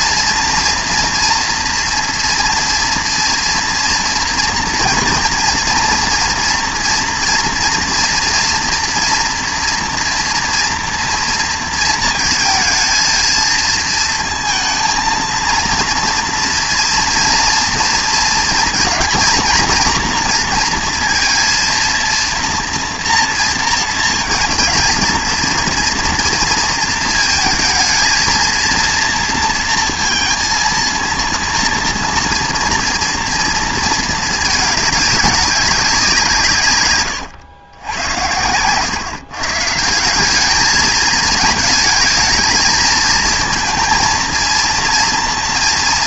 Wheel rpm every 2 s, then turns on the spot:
240, 230, 230, 230, 230, 230, 220, 230, 230, 230, 230, 230, 230, 230, 230, 230, 230, 220, 150, 100, 210, 220, 230.
none